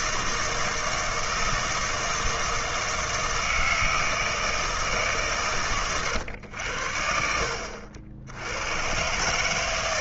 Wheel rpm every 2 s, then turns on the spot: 160, 160, 160, 80, 100.
none